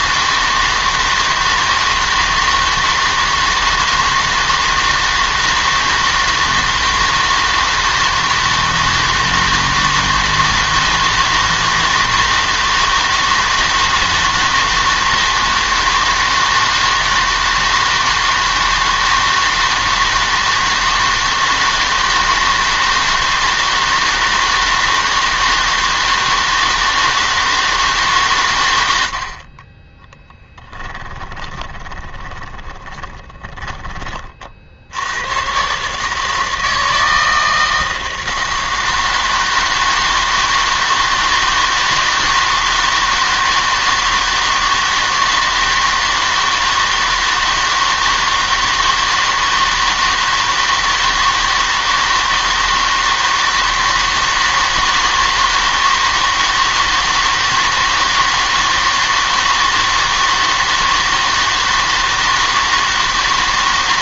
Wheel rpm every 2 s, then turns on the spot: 160, 160, 160, 160, 160, 160, 160, 160, 160, 160, 160, 160, 160, 160, 110, 10, 20, 60, 160, 160, 160, 160, 160, 160, 160, 160, 160, 160, 160, 160, 160, 160.
30-34